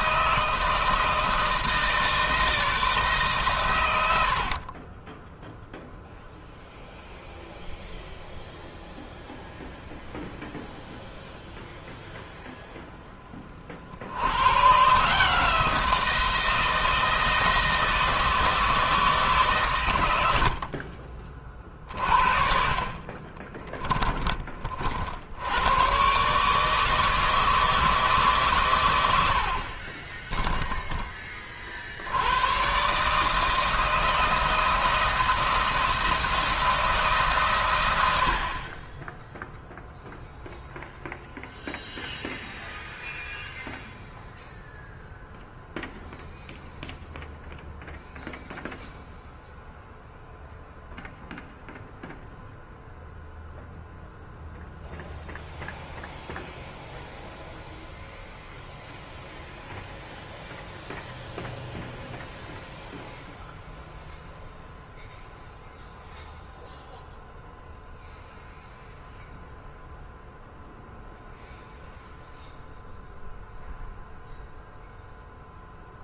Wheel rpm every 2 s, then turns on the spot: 160, 160, 40, 0, 0, 0, 0, 120, 170, 160, 50, 40, 40, 150, 120, 20, 130, 160, 160, 30, 0, 0, 0, 0, 0, 0, 0, 0, 0, 0, 0, 0, 0, 0, 0, 0, 0, 0.
4-6 20-22